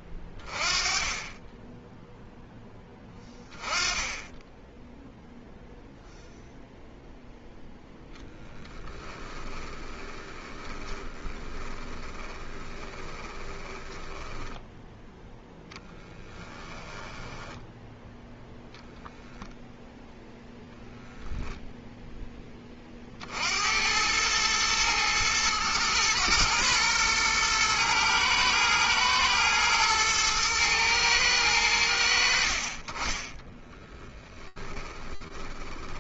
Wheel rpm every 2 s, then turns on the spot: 10, 10, 0, 10, 20, 20, 10, 10, 0, 0, 20, 110, 120, 110, 110, 40, 10, 20.
6-16 32-36